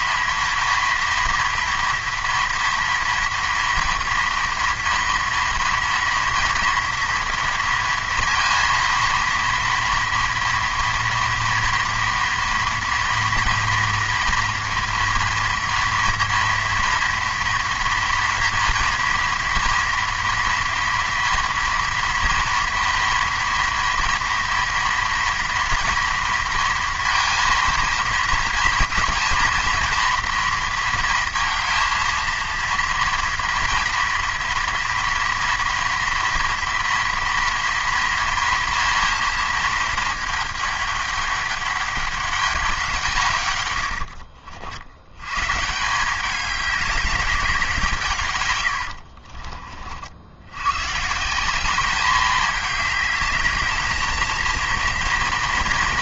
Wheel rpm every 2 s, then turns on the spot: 240, 230, 230, 230, 230, 230, 230, 230, 230, 230, 240, 230, 230, 230, 230, 230, 230, 230, 230, 230, 210, 190, 60, 200, 100, 110, 210, 230.
48-50